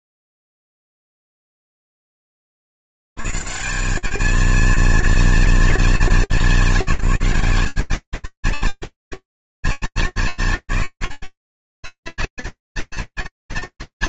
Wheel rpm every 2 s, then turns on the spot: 0, 20, 220, 190, 230, 210, 210.
none